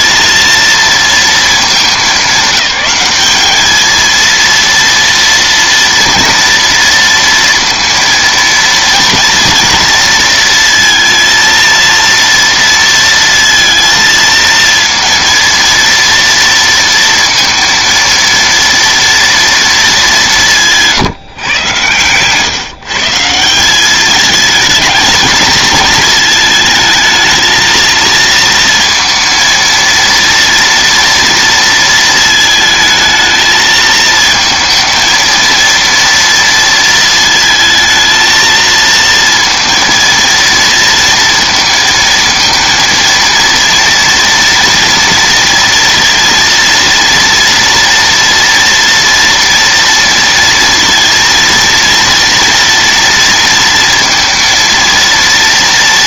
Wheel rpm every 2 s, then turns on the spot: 230, 210, 230, 230, 230, 230, 230, 230, 230, 230, 170, 140, 220, 220, 230, 230, 220, 230, 230, 230, 230, 230, 230, 230, 230, 230, 230, 230.
20-22